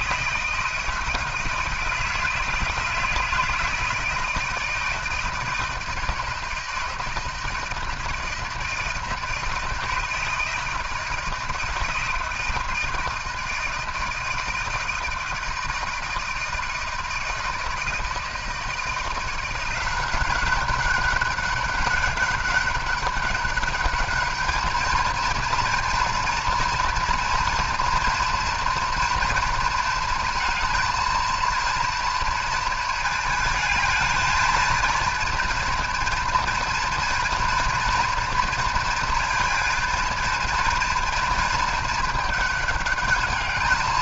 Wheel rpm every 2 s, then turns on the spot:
160, 160, 160, 160, 160, 160, 160, 160, 160, 170, 190, 200, 220, 240, 230, 230, 230, 230, 230, 230, 230, 210.
none